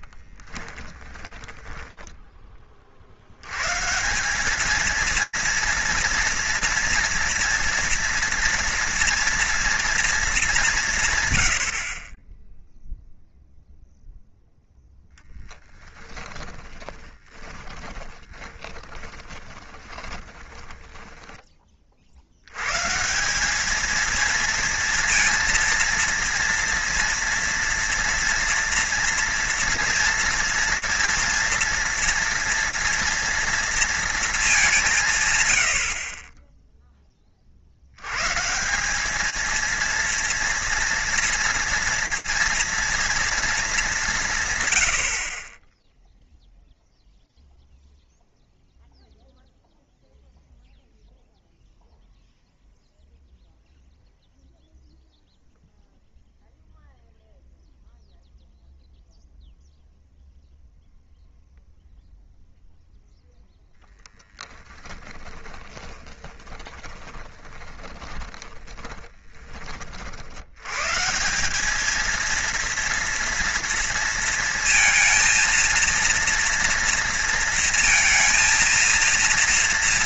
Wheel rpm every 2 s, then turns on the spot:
10, 40, 210, 230, 230, 170, 0, 0, 20, 20, 10, 120, 230, 230, 230, 230, 230, 190, 10, 180, 230, 230, 90, 0, 0, 0, 0, 0, 0, 0, 0, 0, 20, 20, 20, 110, 230, 230, 230, 230.
0-2 16-22 64-70